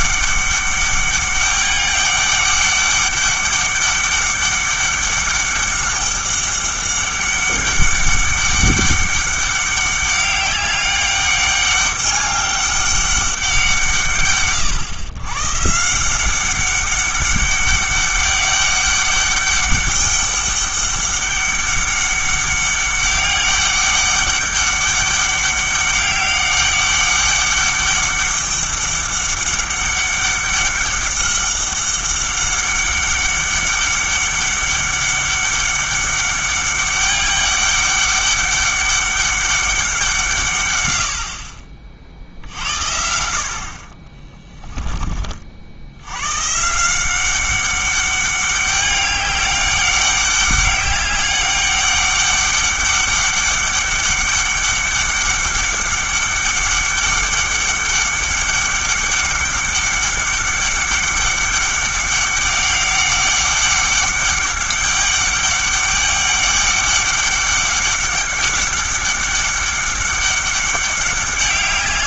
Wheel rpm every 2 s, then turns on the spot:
200, 200, 200, 200, 200, 200, 200, 120, 190, 200, 200, 200, 200, 200, 200, 200, 200, 200, 200, 200, 120, 60, 10, 140, 200, 200, 200, 200, 200, 190, 200, 200, 200, 200, 200, 200.
none